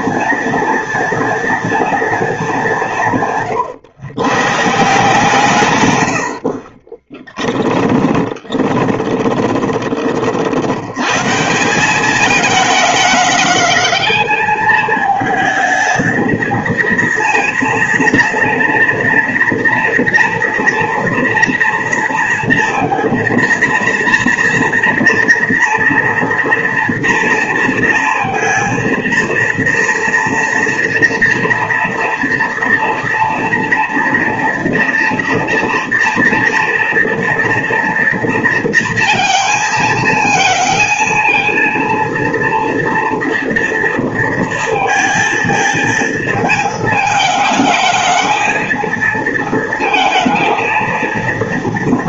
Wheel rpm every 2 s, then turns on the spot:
230, 200, 150, 50, 20, 60, 210, 220, 220, 230, 230, 230, 230, 230, 230, 230, 230, 230, 230, 230, 230, 230, 230, 220, 220, 230.
8-10